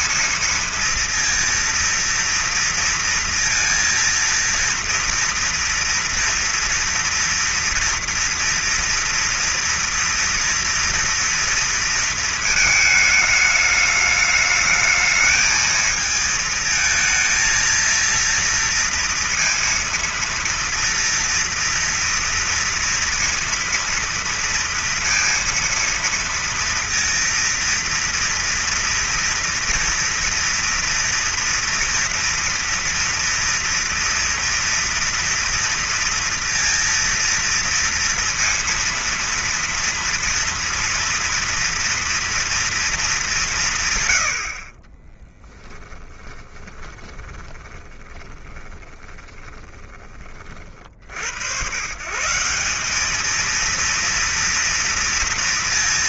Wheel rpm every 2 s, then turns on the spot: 230, 230, 230, 230, 240, 230, 220, 220, 220, 230, 230, 230, 230, 230, 230, 230, 230, 230, 230, 230, 230, 220, 20, 20, 20, 80, 200, 230.
46-50